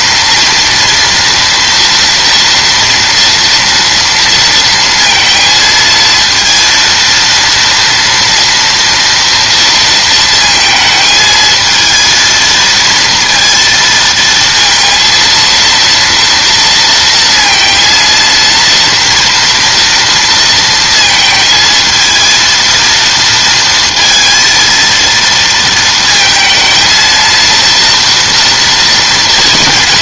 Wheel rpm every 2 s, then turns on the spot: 240, 230, 230, 230, 230, 220, 230, 230, 230, 230, 230, 230, 230, 230, 230.
none